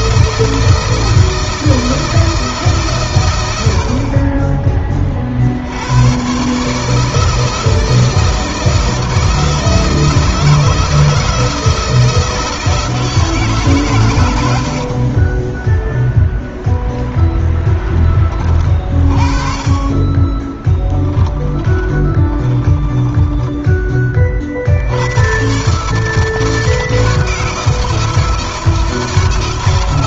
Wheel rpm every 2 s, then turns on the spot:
160, 130, 40, 160, 170, 160, 160, 50, 20, 30, 10, 10, 90, 160, 160.
14-18 20-24